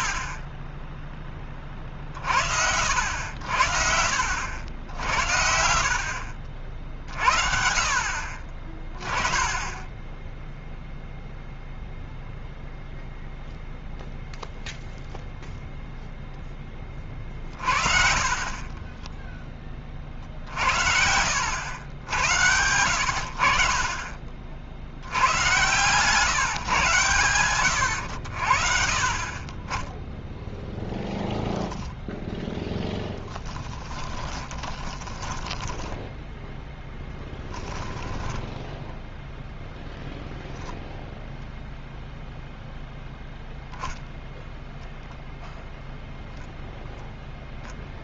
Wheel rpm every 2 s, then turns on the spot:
30, 50, 60, 60, 40, 0, 0, 0, 10, 40, 60, 90, 60, 120, 70, 10, 0, 20, 10, 10, 0, 0, 0, 0.
18-22 34-40